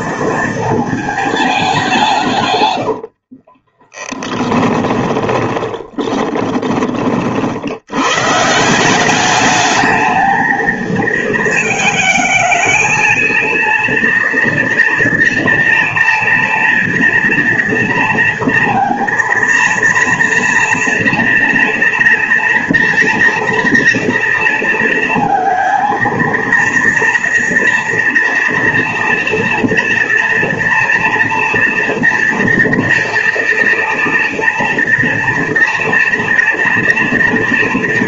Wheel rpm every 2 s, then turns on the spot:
220, 90, 10, 40, 180, 220, 230, 230, 230, 230, 230, 230, 230, 230, 230, 230, 230, 230, 230.
2-8